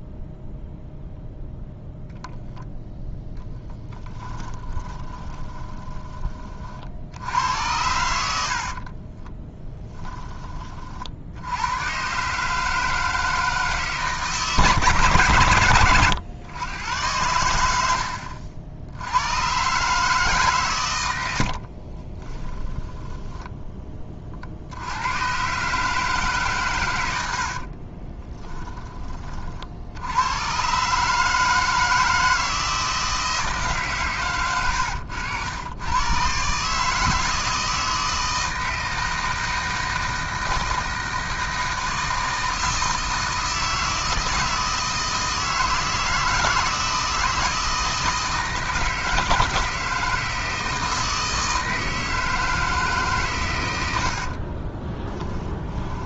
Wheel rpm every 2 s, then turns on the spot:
0, 10, 30, 50, 40, 50, 160, 140, 110, 70, 110, 10, 80, 120, 20, 130, 160, 100, 150, 160, 160, 160, 160, 160, 160, 160, 150, 30.
4-6 8-10 22-24 54-56